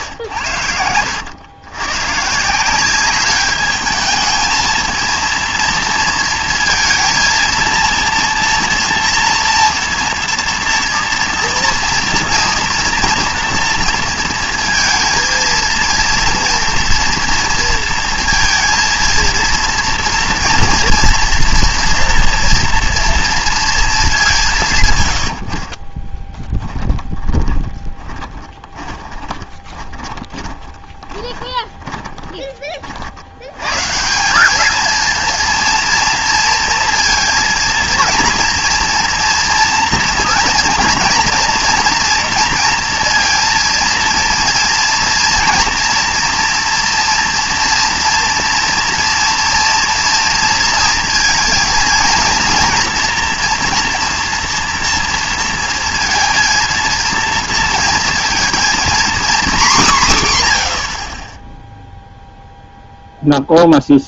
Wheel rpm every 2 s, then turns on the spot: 90, 180, 220, 230, 240, 230, 230, 230, 240, 230, 230, 240, 150, 10, 20, 20, 40, 210, 230, 230, 230, 230, 230, 230, 240, 230, 230, 240, 230, 230, 100, 0.
26-32